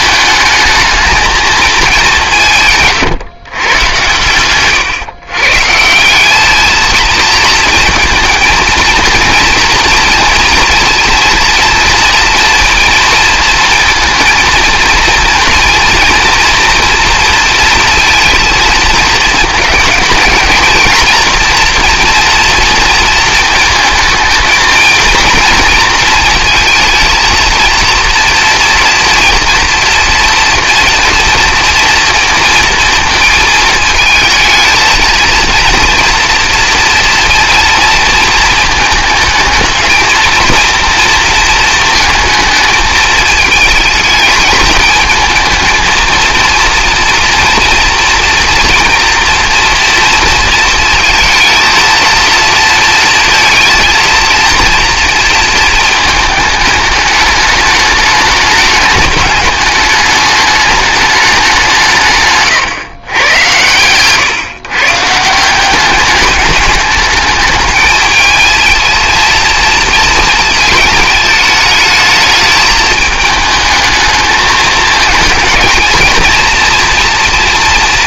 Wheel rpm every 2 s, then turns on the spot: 220, 150, 130, 210, 230, 230, 230, 230, 230, 220, 220, 230, 220, 230, 230, 230, 230, 220, 230, 220, 230, 220, 220, 230, 230, 230, 230, 230, 210, 210, 210, 130, 150, 200, 220, 220, 220, 210, 230.
2-6